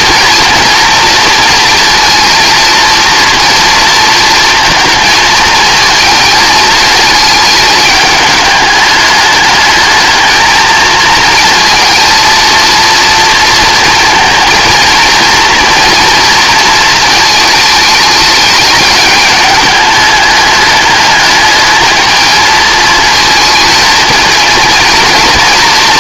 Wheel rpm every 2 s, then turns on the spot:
230, 230, 230, 220, 210, 220, 230, 220, 230, 210, 210, 230, 230.
none